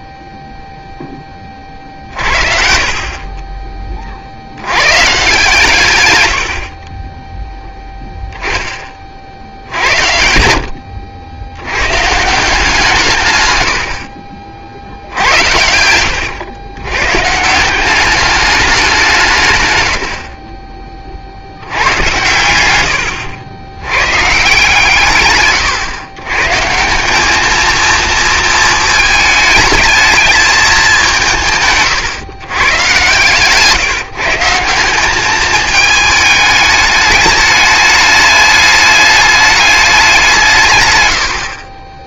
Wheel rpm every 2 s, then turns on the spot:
0, 50, 110, 50, 20, 70, 180, 70, 120, 170, 50, 90, 130, 210, 220, 170, 130, 200, 210, 210, 70.
14-16